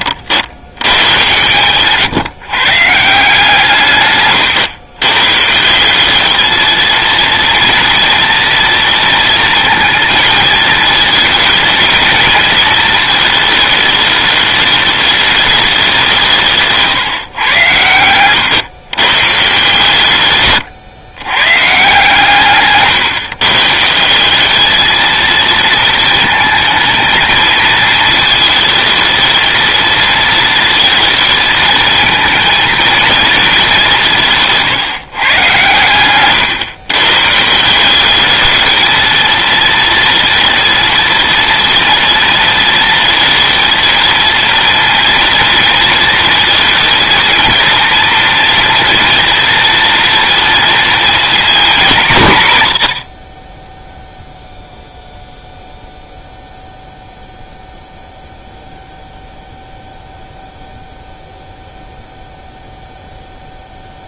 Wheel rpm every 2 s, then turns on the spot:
100, 150, 120, 230, 230, 220, 220, 210, 150, 130, 110, 140, 220, 220, 220, 230, 230, 140, 130, 220, 230, 230, 230, 230, 230, 230, 100, 0, 0, 0, 0, 0.
none